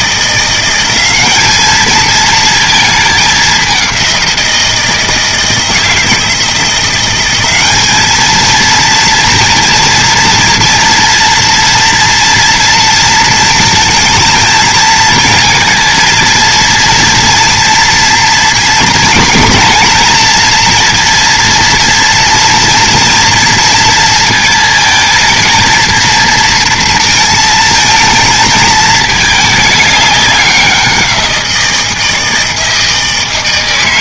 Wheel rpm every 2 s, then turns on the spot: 180, 220, 170, 170, 230, 230, 230, 230, 230, 230, 230, 230, 220, 230, 220, 190, 160.
none